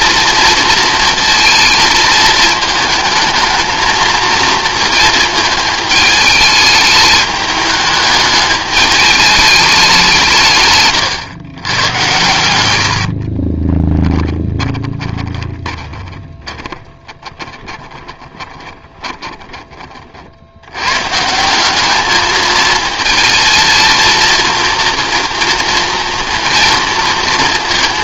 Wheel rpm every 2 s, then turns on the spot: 220, 220, 220, 210, 210, 140, 90, 20, 20, 20, 90, 220, 230, 230.
14-20